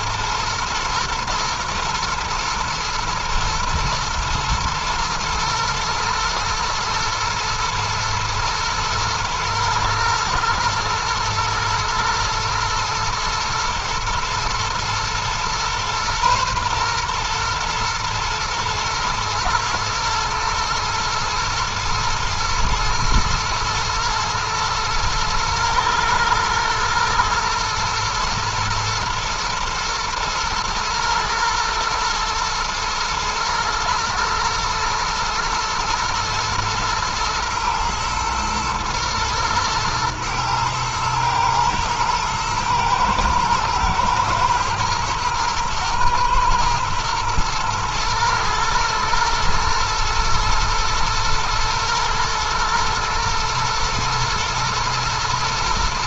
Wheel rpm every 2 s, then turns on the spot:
110, 110, 120, 120, 120, 120, 110, 120, 120, 120, 110, 110, 110, 110, 110, 110, 110, 120, 110, 110, 110, 110, 110, 120, 110, 110, 110, 110.
none